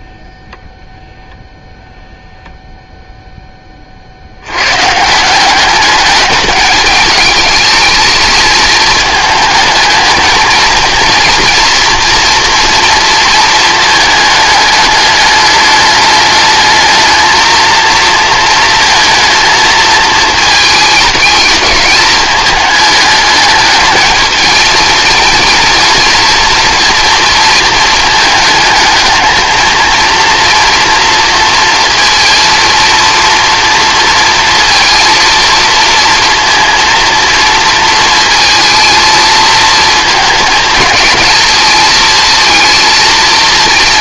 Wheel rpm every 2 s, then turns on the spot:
0, 0, 150, 210, 220, 230, 230, 210, 220, 230, 220, 220, 230, 230, 220, 230, 240, 230, 230, 230, 220, 220.
none